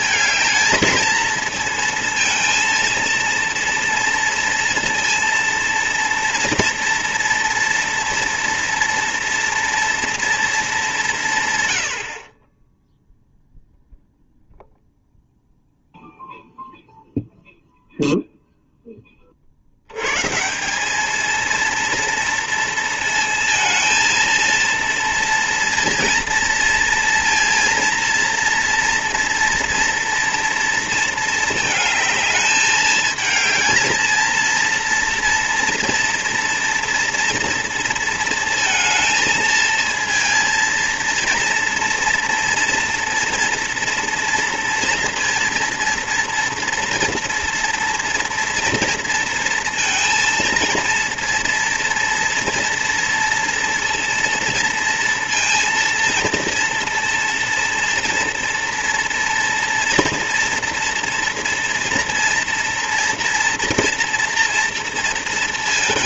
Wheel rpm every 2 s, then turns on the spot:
220, 230, 230, 230, 230, 210, 10, 0, 0, 0, 190, 230, 230, 230, 230, 230, 220, 230, 230, 230, 230, 230, 240, 240, 230, 230, 230, 230, 230, 230, 230, 230, 230.
none